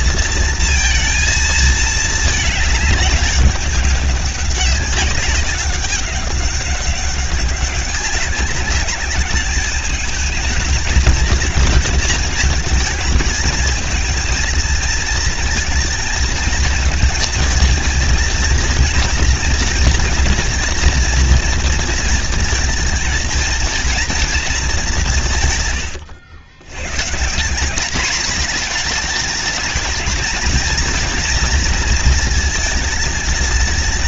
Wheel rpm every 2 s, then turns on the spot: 230, 210, 190, 200, 190, 220, 220, 230, 230, 230, 230, 230, 210, 100, 220, 230, 220.
none